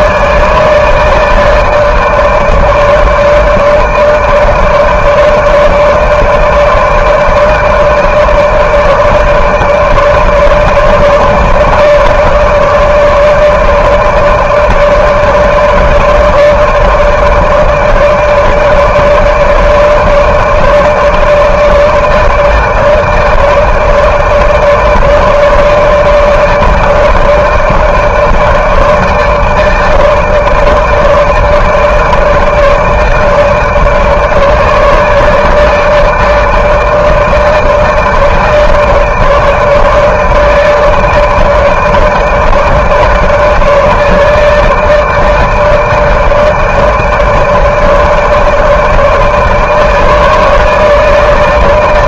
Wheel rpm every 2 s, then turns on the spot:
160, 160, 150, 150, 150, 160, 150, 150, 150, 150, 150, 150, 160, 150, 150, 160, 150, 160, 160, 160, 150, 150, 150, 160, 150, 160.
none